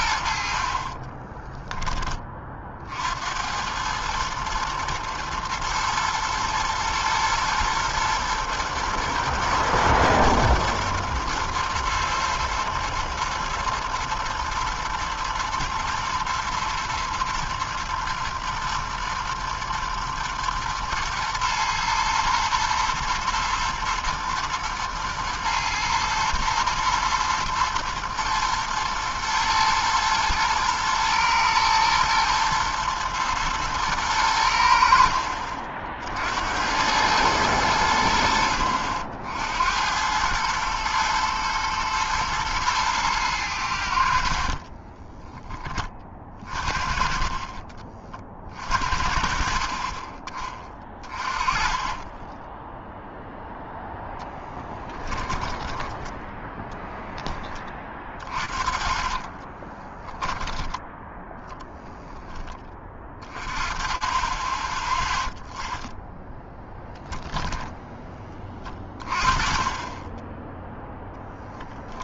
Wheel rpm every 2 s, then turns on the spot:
60, 30, 110, 110, 110, 110, 110, 110, 110, 110, 120, 120, 120, 120, 120, 110, 110, 90, 80, 70, 100, 110, 50, 40, 40, 20, 10, 10, 10, 30, 10, 20, 20, 10, 20, 10.
44-46 52-60